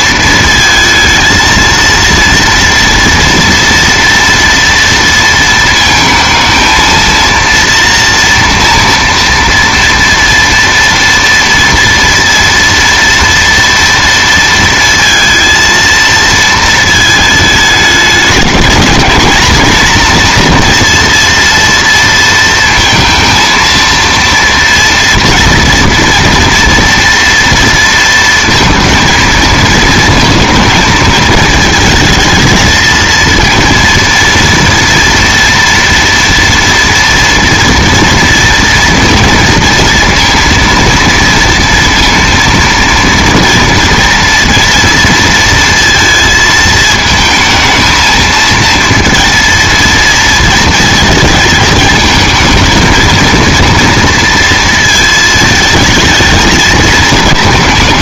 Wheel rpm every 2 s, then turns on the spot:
230, 230, 230, 230, 230, 230, 230, 230, 220, 210, 230, 230, 230, 230, 230, 220, 220, 230, 240, 230, 230, 230, 230, 220, 230, 220, 230, 220, 220.
none